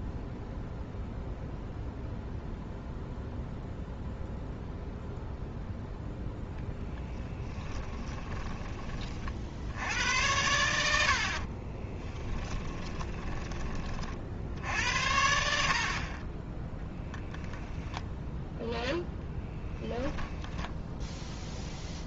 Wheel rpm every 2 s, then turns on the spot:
0, 0, 0, 10, 40, 80, 20, 70, 20, 10, 10.
12-14